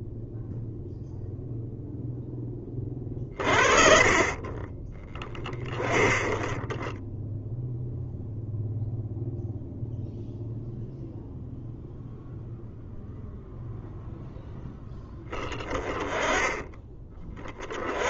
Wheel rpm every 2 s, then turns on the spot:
0, 20, 10, 10, 0, 0, 0, 10, 20.
none